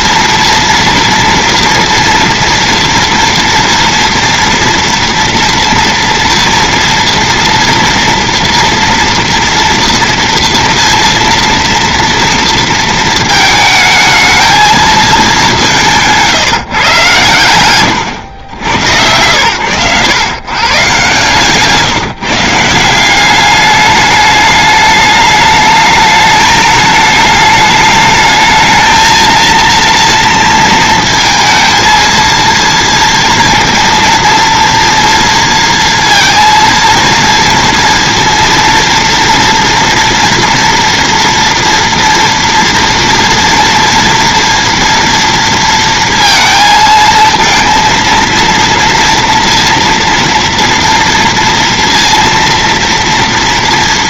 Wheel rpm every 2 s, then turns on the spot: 230, 230, 230, 230, 230, 230, 230, 220, 130, 100, 140, 170, 210, 220, 220, 230, 230, 230, 230, 230, 230, 230, 230, 220, 230, 230, 240.
none